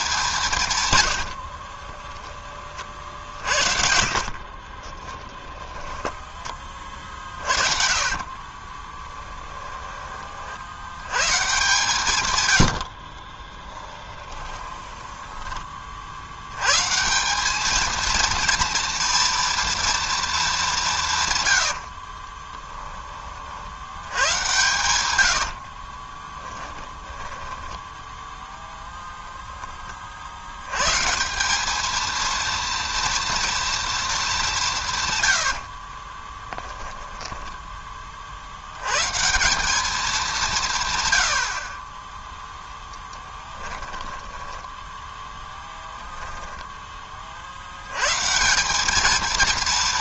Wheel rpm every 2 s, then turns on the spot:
130, 40, 30, 30, 30, 50, 80, 20, 130, 230, 190, 20, 100, 10, 0, 120, 230, 170, 10, 100, 150, 0, 10, 10, 190.
2-10 14-16 22-28 36-38 44-46